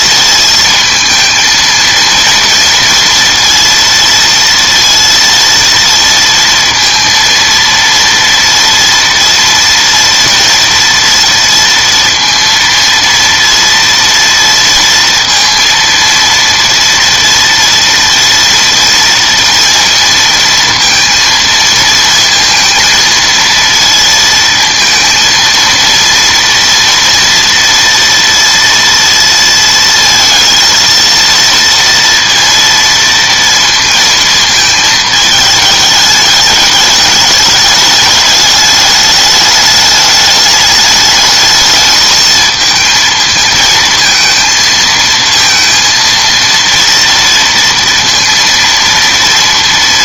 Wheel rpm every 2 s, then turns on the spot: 230, 230, 230, 230, 230, 240, 230, 230, 230, 230, 230, 230, 230, 230, 230, 230, 230, 220, 210, 210, 210, 220, 230, 230, 230.
none